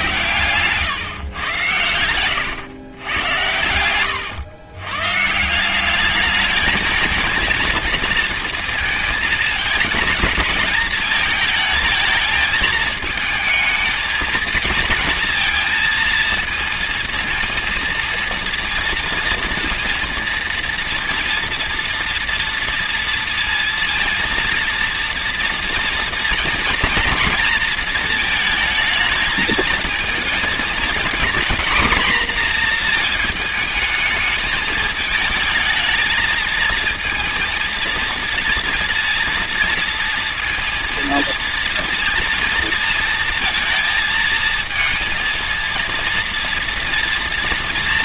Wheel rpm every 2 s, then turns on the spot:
120, 120, 110, 220, 230, 220, 220, 220, 230, 230, 230, 230, 230, 240, 220, 220, 230, 210, 220, 230, 230, 230, 230, 230.
0-2